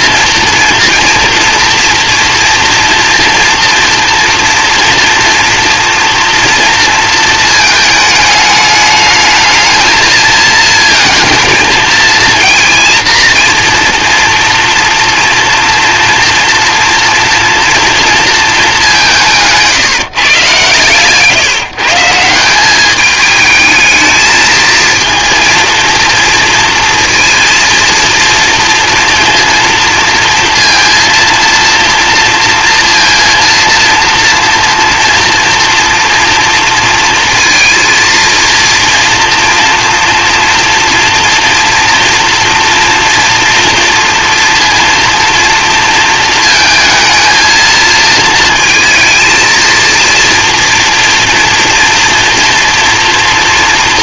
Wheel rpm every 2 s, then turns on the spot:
230, 230, 230, 230, 210, 230, 230, 230, 240, 210, 140, 190, 220, 230, 230, 230, 230, 230, 230, 230, 230, 230, 230, 220, 230, 230, 230.
none